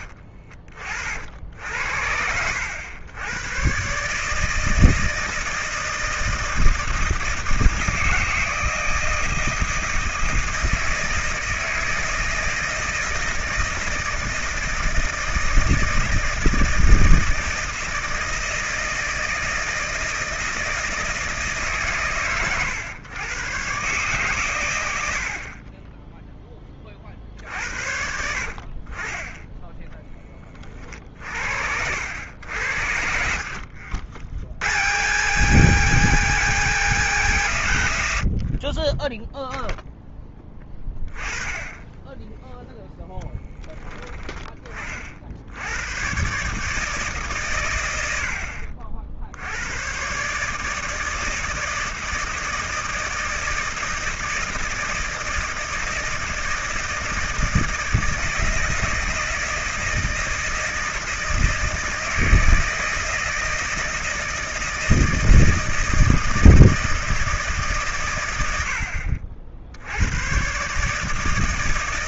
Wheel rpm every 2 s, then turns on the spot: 60, 80, 160, 160, 160, 160, 160, 160, 160, 160, 160, 110, 120, 10, 60, 30, 80, 80, 170, 60, 10, 10, 20, 140, 60, 150, 160, 160, 160, 160, 160, 160, 160, 160, 90, 130.
42-44